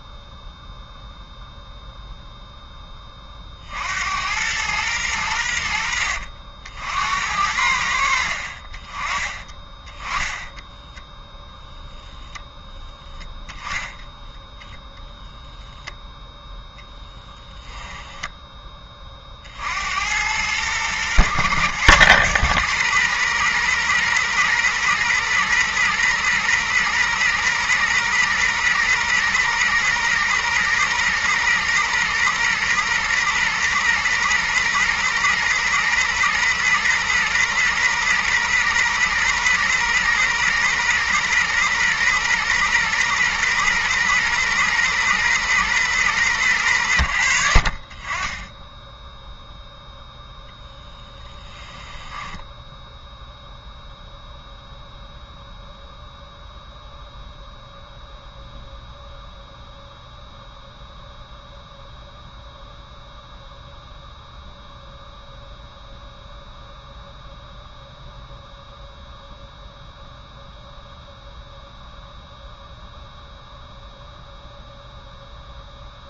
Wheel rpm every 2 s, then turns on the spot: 0, 30, 100, 70, 30, 0, 10, 0, 10, 30, 110, 120, 120, 120, 120, 120, 120, 120, 120, 120, 120, 120, 120, 90, 0, 10, 0, 0, 0, 0, 0, 0, 0, 0, 0, 0, 0, 0.
16-18 50-52